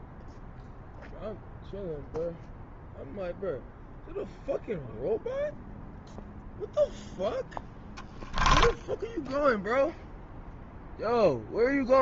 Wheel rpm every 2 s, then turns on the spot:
0, 0, 0, 0, 10, 0.
none